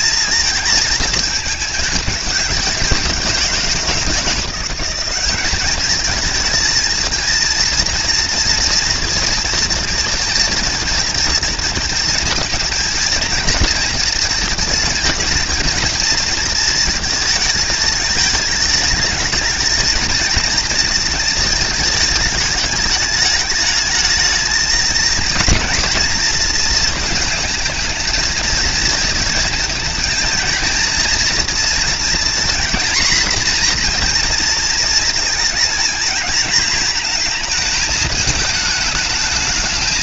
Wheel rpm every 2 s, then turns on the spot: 220, 200, 180, 220, 230, 230, 220, 230, 230, 220, 230, 210, 220, 230, 230, 230, 230, 230, 230, 220.
none